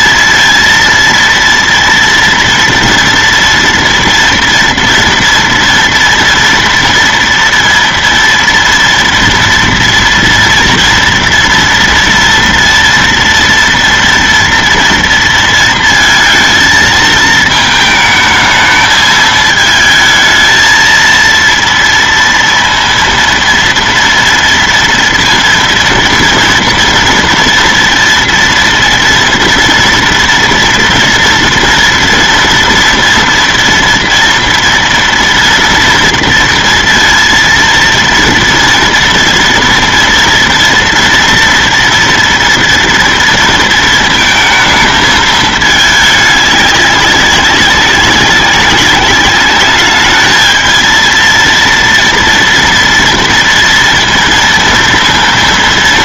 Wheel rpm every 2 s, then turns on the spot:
230, 230, 230, 230, 230, 230, 230, 230, 220, 220, 220, 230, 230, 230, 230, 230, 230, 230, 230, 230, 230, 230, 220, 200, 200, 220, 230, 230.
none